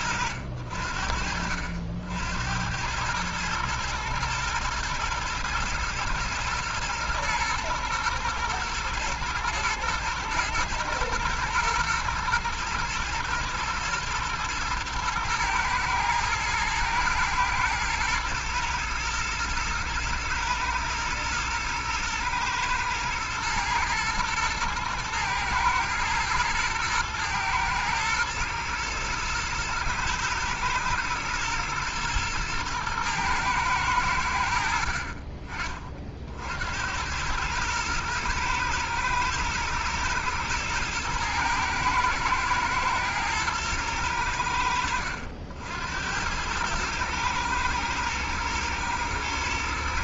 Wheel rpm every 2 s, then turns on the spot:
70, 110, 110, 110, 120, 110, 110, 110, 110, 110, 110, 110, 110, 110, 110, 110, 110, 30, 110, 110, 110, 110, 70, 110, 110.
none